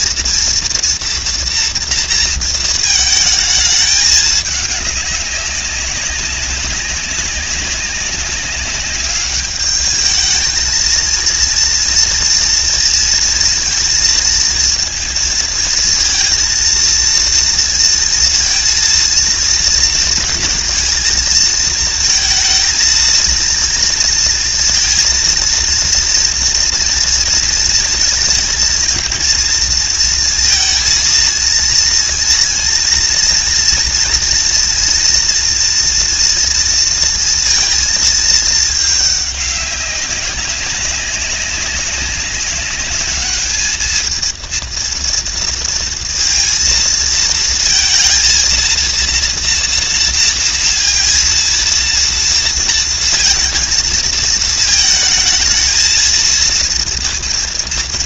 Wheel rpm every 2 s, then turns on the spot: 230, 220, 200, 200, 200, 220, 230, 220, 230, 230, 220, 230, 230, 230, 230, 230, 230, 230, 230, 210, 190, 210, 230, 230, 230, 230, 230, 220, 230.
none